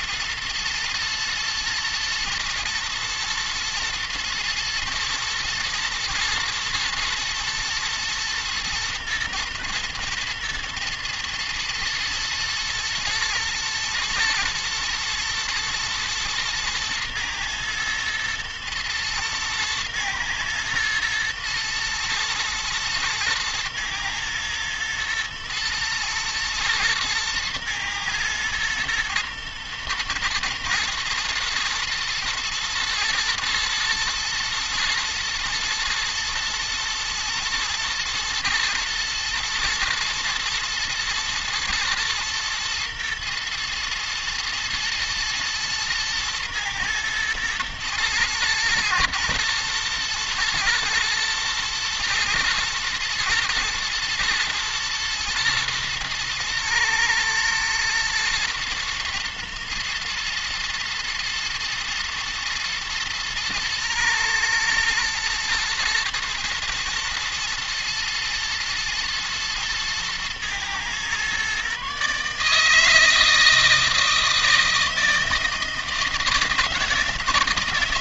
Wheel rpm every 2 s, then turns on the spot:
120, 120, 120, 120, 110, 110, 120, 110, 120, 110, 120, 120, 120, 110, 120, 120, 120, 110, 120, 110, 120, 120, 110, 110, 120, 120, 120, 120, 110, 120, 110, 120, 120, 120, 110, 120, 150, 160, 160.
none